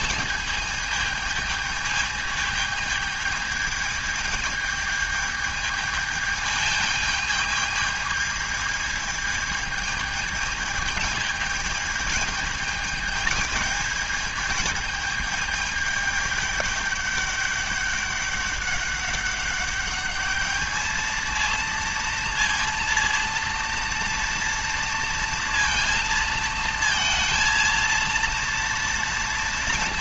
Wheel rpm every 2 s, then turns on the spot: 220, 220, 220, 220, 220, 220, 220, 220, 210, 200, 220, 230, 230, 220, 230.
none